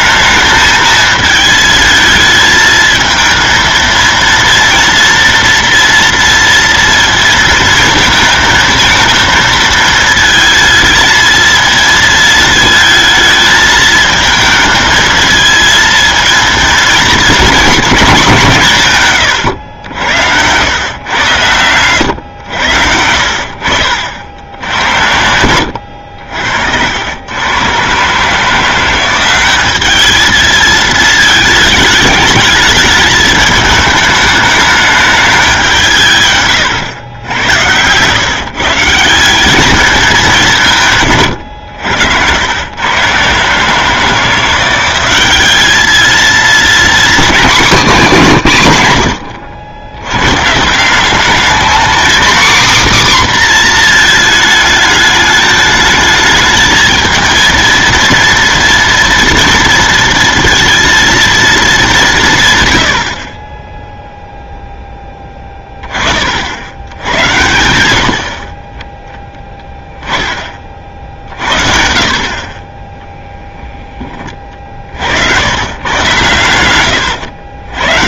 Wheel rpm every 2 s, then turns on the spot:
220, 220, 230, 230, 230, 220, 220, 220, 220, 160, 100, 70, 70, 70, 160, 220, 210, 210, 120, 150, 170, 110, 180, 240, 150, 160, 260, 220, 220, 230, 230, 130, 10, 80, 40, 40, 20, 40, 110.
36-38 76-78